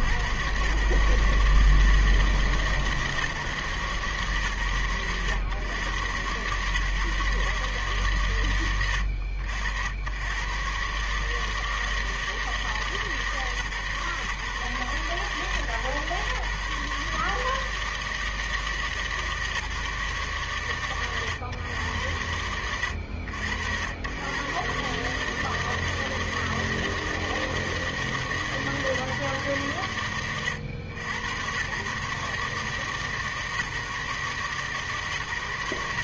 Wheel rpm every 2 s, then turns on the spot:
60, 160, 130, 120, 130, 70, 160, 140, 140, 160, 130, 90, 90, 160, 160, 100, 140, 150.
none